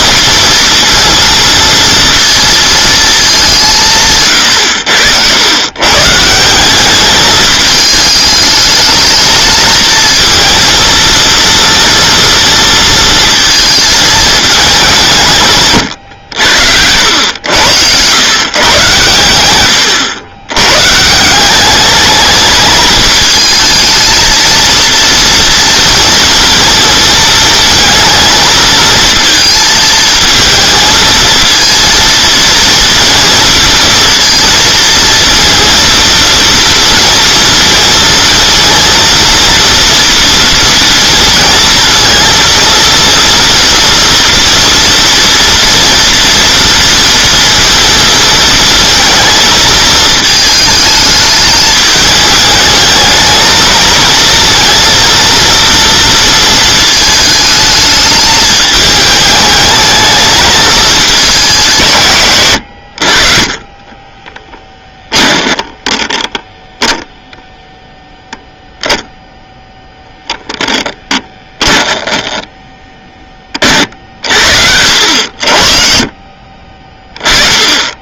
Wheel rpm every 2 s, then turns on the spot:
230, 230, 100, 190, 220, 230, 230, 210, 90, 120, 120, 220, 230, 230, 220, 220, 230, 230, 230, 230, 230, 230, 230, 230, 230, 220, 210, 230, 220, 210, 220, 80, 10, 10, 0, 10, 10, 70, 30.
64-66 70-72